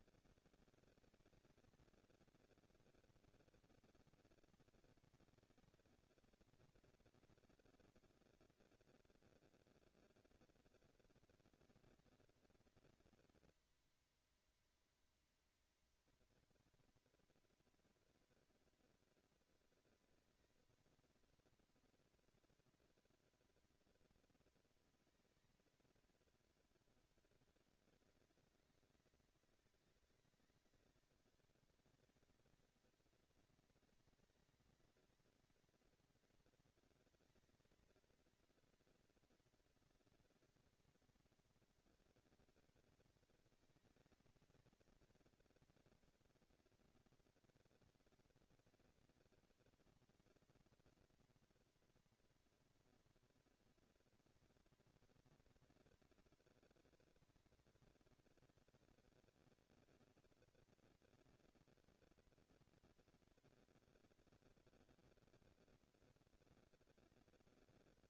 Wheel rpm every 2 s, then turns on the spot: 220, 230, 230, 230, 230, 230, 230, 230, 230, 230, 230, 240, 230, 210, 190, 190, 220, 230, 230, 230, 230, 230, 230, 230, 230, 230, 230, 230, 230, 220, 230, 230, 240, 230.
none